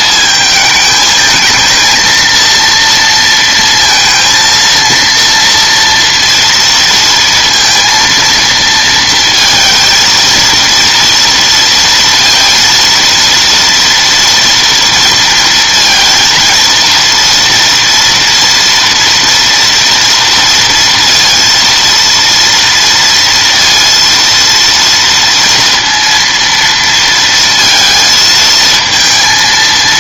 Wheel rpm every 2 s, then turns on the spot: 220, 230, 230, 230, 230, 230, 230, 230, 230, 230, 230, 230, 230, 230, 220.
none